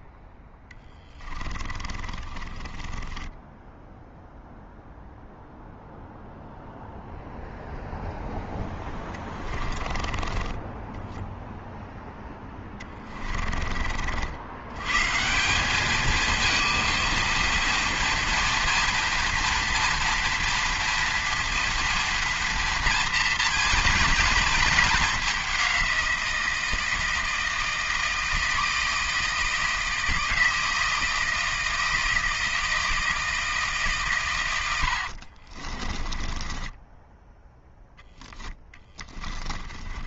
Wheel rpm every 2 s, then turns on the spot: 10, 20, 0, 0, 10, 20, 20, 120, 230, 230, 230, 230, 220, 170, 160, 160, 160, 80, 10, 10.
0-4 8-14 34-40